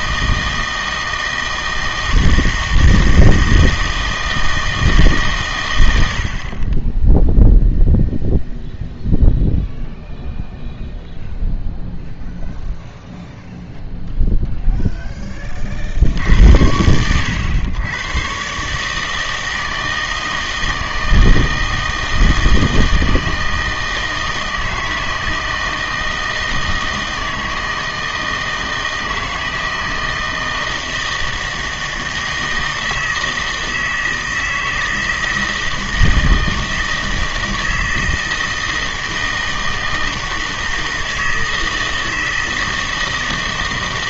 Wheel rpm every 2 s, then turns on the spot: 160, 160, 160, 30, 0, 0, 0, 0, 80, 140, 160, 160, 160, 160, 160, 160, 160, 160, 160, 160, 160, 160.
none